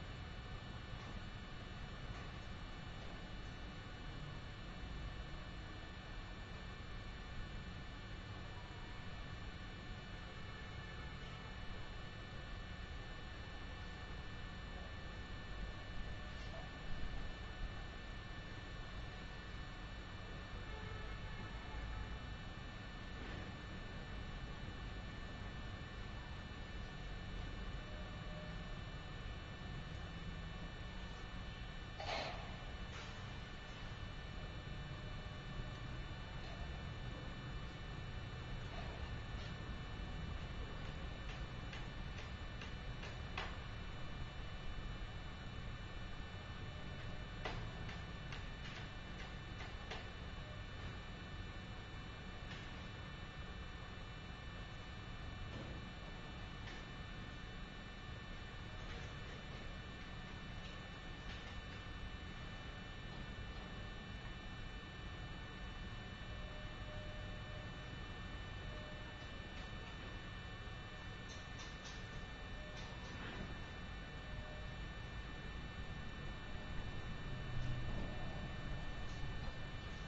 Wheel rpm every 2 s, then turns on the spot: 0, 0, 0, 0, 0, 0, 0, 0, 0, 0, 0, 0, 0, 0, 0, 0, 0, 0, 0, 0, 0, 0, 0, 0, 0, 0, 0, 0, 0, 0, 0, 0, 0, 0, 0, 0, 0, 0, 0, 0.
none